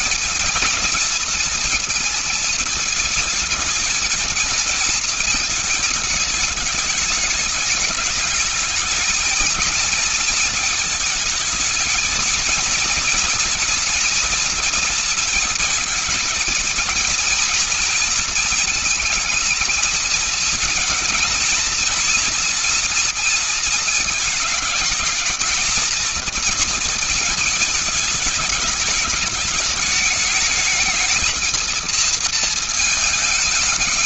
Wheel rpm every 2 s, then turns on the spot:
230, 220, 220, 220, 210, 220, 220, 240, 230, 230, 230, 230, 220, 230, 210, 210, 230.
none